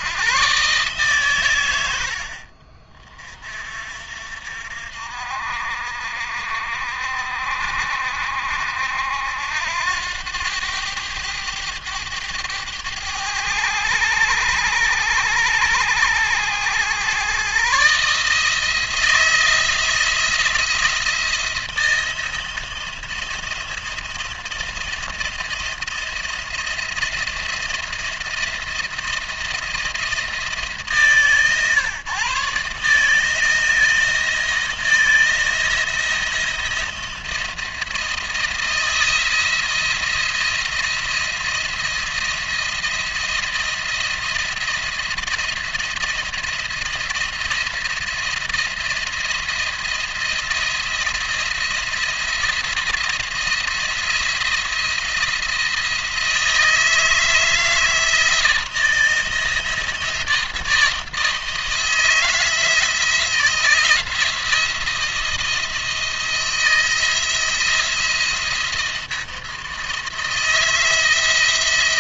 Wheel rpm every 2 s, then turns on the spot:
130, 50, 60, 60, 70, 100, 100, 100, 110, 160, 170, 170, 170, 170, 170, 150, 150, 160, 160, 160, 170, 170, 170, 170, 170, 170, 170, 170, 160, 160, 170, 170, 170, 170, 170, 160.
none